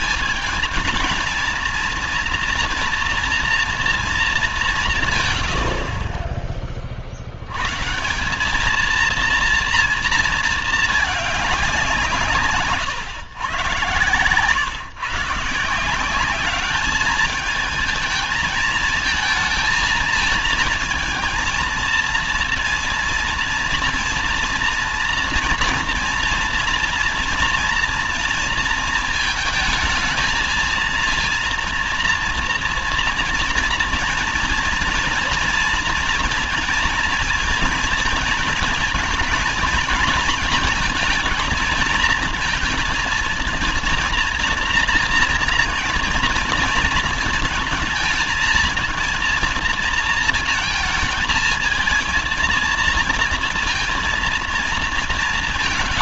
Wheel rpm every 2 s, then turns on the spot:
210, 230, 200, 30, 210, 220, 150, 130, 200, 220, 230, 230, 230, 230, 230, 220, 230, 230, 230, 230, 230, 230, 230, 230, 230, 220, 220, 230.
12-14